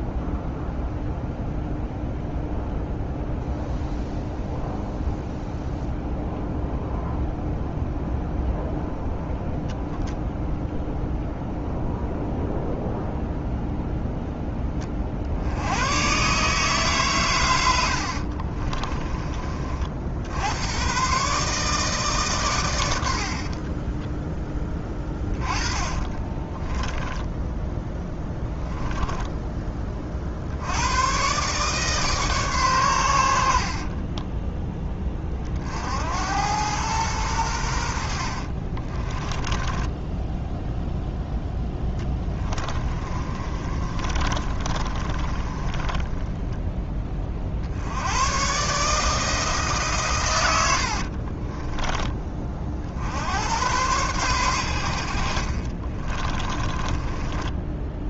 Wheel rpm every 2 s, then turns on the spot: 0, 0, 0, 0, 0, 0, 0, 30, 140, 30, 110, 100, 20, 10, 10, 90, 120, 10, 110, 30, 0, 30, 30, 10, 150, 70, 60, 80, 20.
18-20 24-30 38-40 42-46 50-52 56-58